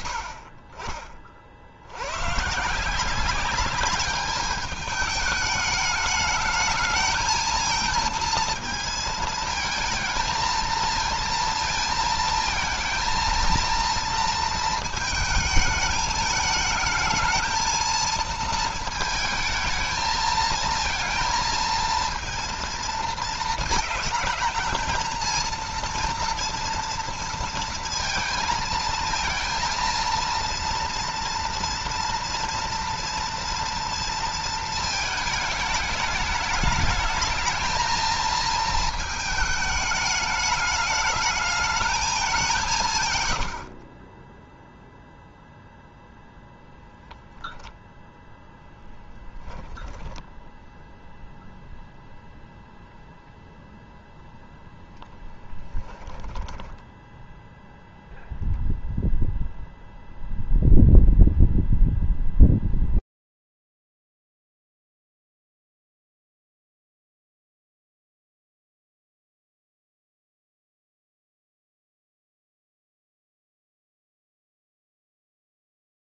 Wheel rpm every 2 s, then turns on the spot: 20, 160, 210, 220, 230, 230, 230, 220, 220, 220, 230, 230, 220, 230, 230, 230, 230, 220, 210, 220, 210, 160, 0, 0, 10, 0, 0, 10, 10, 0, 0, 0, 0, 0, 0, 0, 0, 0.
56-58